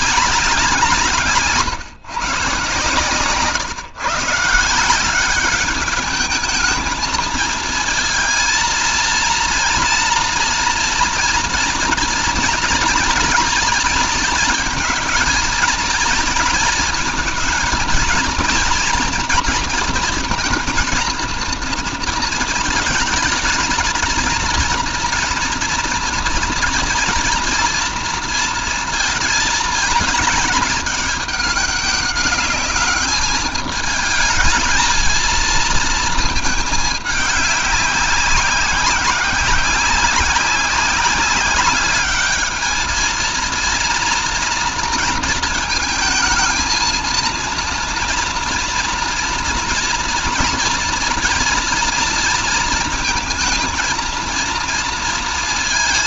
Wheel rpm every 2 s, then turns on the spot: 130, 130, 190, 220, 230, 230, 230, 230, 220, 230, 230, 220, 230, 240, 220, 210, 200, 220, 210, 190, 190, 220, 230, 230, 230, 230, 230, 230.
none